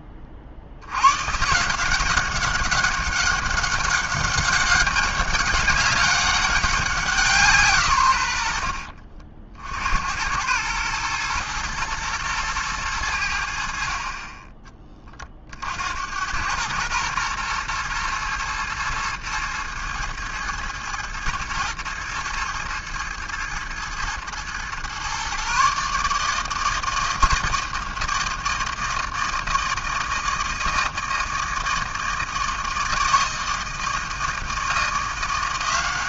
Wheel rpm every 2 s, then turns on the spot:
80, 200, 200, 200, 70, 110, 110, 30, 100, 110, 110, 110, 120, 160, 160, 160, 160, 160.
none